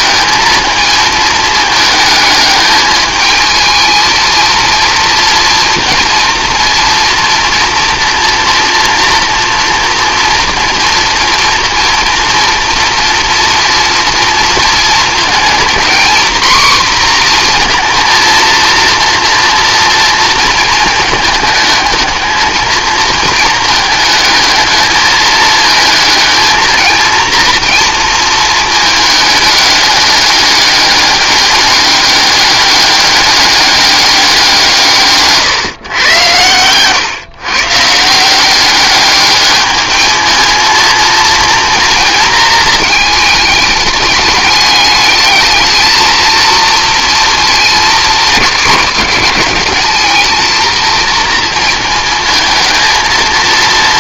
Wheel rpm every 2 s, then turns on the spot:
220, 210, 230, 230, 230, 240, 230, 230, 250, 230, 220, 220, 220, 220, 220, 200, 200, 170, 120, 200, 230, 220, 210, 230, 210, 230, 220.
none